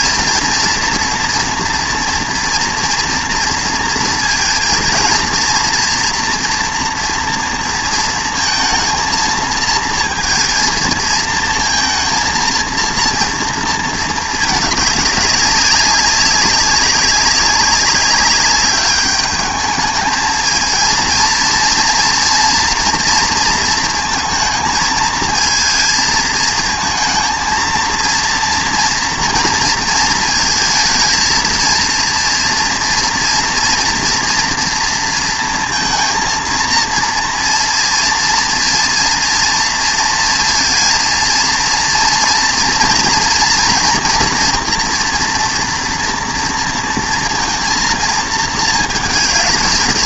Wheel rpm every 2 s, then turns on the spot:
230, 230, 230, 230, 230, 230, 230, 210, 200, 200, 230, 240, 220, 220, 230, 230, 230, 230, 230, 230, 230, 230, 240, 230, 220.
none